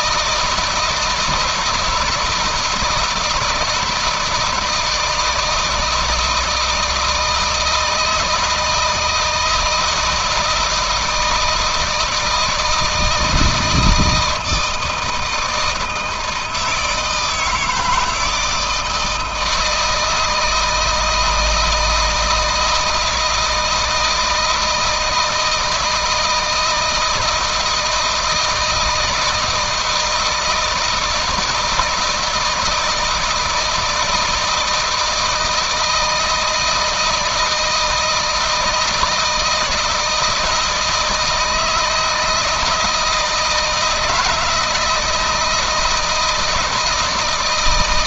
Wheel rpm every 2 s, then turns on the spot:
160, 160, 160, 160, 160, 160, 160, 160, 160, 160, 160, 160, 160, 160, 160, 170, 160, 170, 160, 160, 160, 160, 160, 160.
none